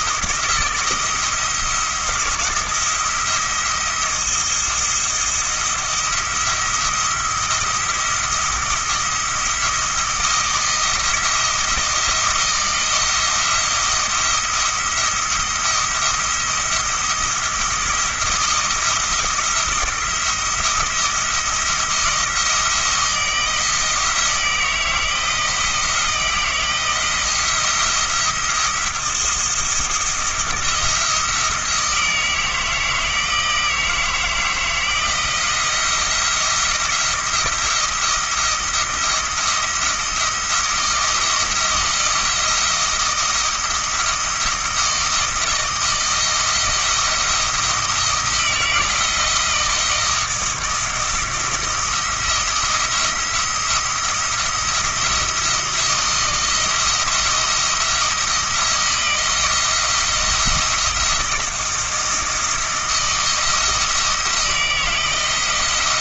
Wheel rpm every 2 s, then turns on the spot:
160, 170, 170, 170, 170, 170, 170, 170, 170, 170, 170, 160, 160, 170, 170, 170, 160, 160, 170, 170, 170, 170, 160, 170, 160, 170, 170, 170, 170, 170, 170, 160, 160.
none